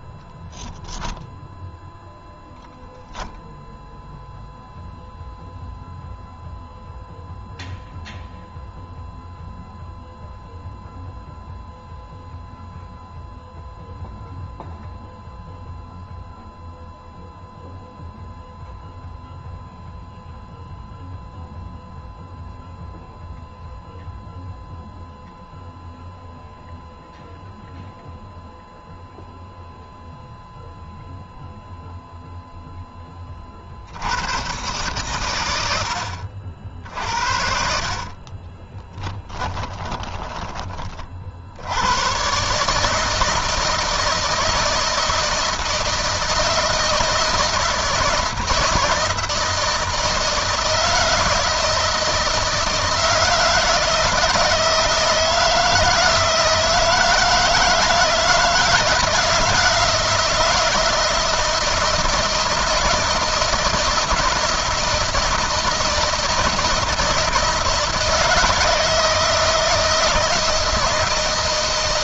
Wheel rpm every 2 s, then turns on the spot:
0, 0, 0, 0, 0, 0, 0, 0, 0, 0, 0, 0, 0, 0, 0, 0, 30, 130, 60, 10, 30, 150, 160, 160, 160, 160, 160, 160, 160, 160, 160, 160, 160, 160, 160, 160.
38-40